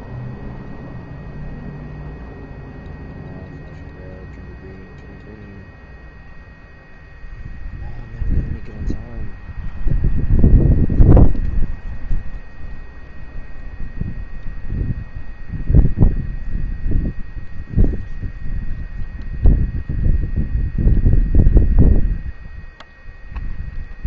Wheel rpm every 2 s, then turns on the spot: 0, 0, 0, 0, 0, 0, 0, 0, 0, 0, 0, 0.
none